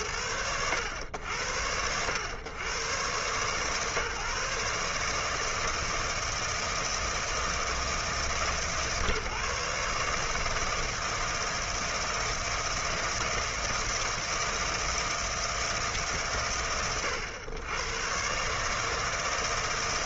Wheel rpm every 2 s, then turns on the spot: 100, 120, 160, 160, 150, 160, 160, 160, 100, 160.
none